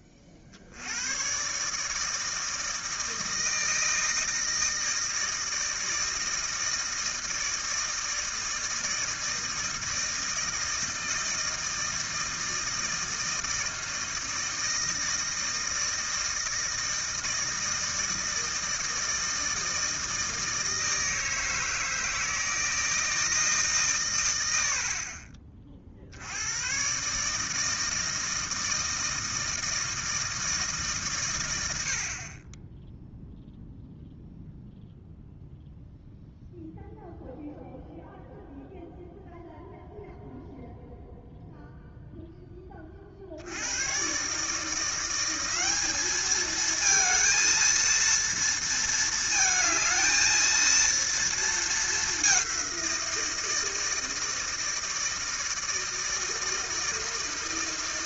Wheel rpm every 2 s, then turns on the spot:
50, 160, 160, 160, 160, 160, 160, 160, 160, 160, 160, 160, 80, 120, 160, 150, 20, 0, 0, 0, 0, 30, 170, 220, 230, 230, 180, 160, 160.
24-26